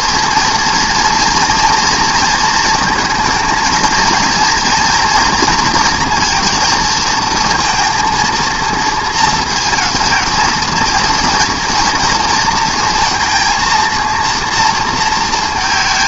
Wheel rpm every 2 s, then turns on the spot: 230, 230, 230, 230, 230, 230, 230, 230.
none